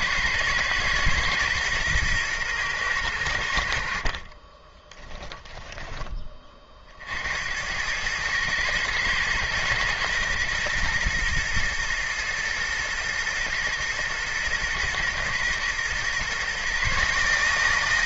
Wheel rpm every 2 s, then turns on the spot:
120, 110, 20, 50, 120, 110, 110, 120, 140.
4-6